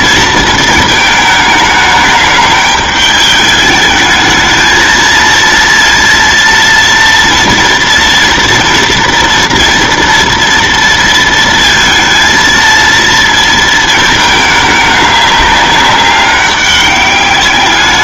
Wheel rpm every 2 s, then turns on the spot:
230, 210, 220, 230, 230, 230, 230, 210, 200.
none